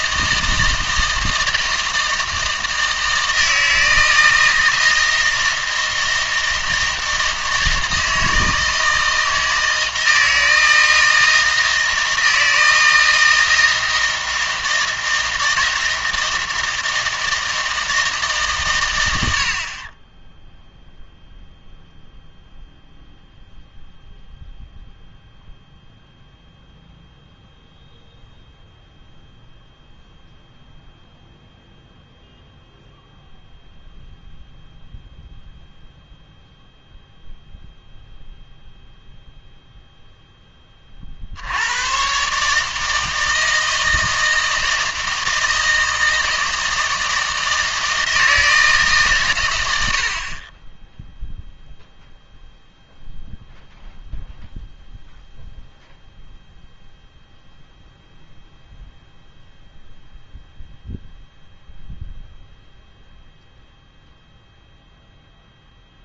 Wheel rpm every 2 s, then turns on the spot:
160, 160, 160, 160, 160, 160, 160, 160, 160, 100, 0, 0, 0, 0, 0, 0, 0, 0, 0, 0, 30, 160, 160, 160, 150, 20, 0, 0, 0, 0, 0, 0, 0.
none